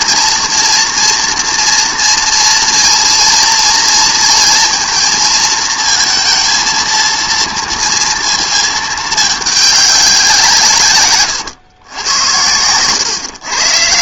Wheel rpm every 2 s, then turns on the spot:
230, 230, 230, 230, 230, 160, 100.
none